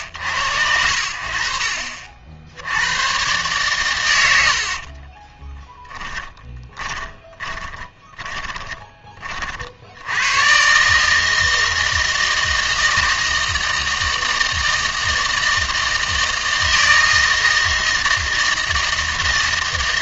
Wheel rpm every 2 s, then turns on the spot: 80, 80, 60, 20, 10, 130, 160, 160, 160, 160.
6-8